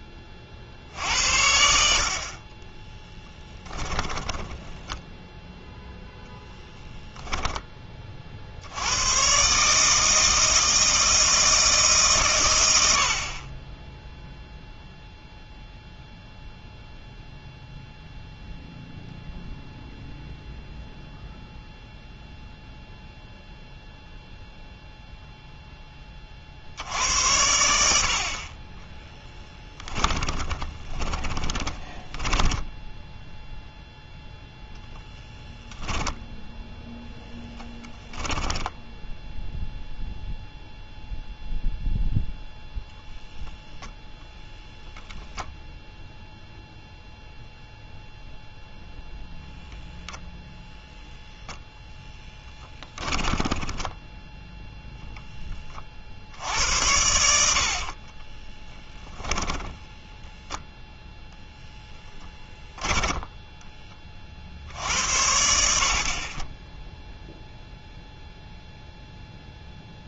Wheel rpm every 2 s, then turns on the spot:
60, 20, 10, 10, 70, 160, 100, 0, 0, 0, 0, 0, 0, 70, 20, 20, 10, 0, 0, 10, 0, 0, 0, 0, 0, 0, 10, 10, 80, 10, 0, 10, 70, 10, 0.
2-6 30-34 38-40 52-54 58-60 62-64